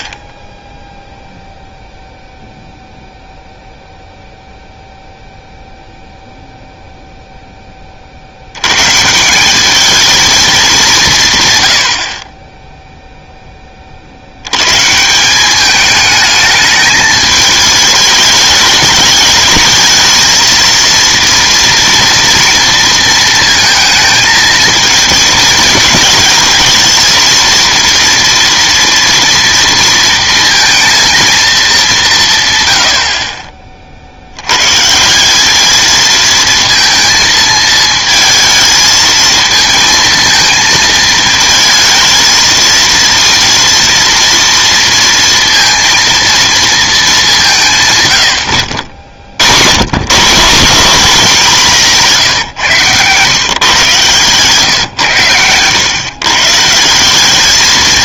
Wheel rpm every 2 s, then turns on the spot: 10, 0, 0, 0, 100, 210, 10, 110, 220, 210, 230, 230, 220, 220, 230, 230, 120, 110, 220, 220, 220, 230, 230, 230, 80, 170, 130, 130, 160.
none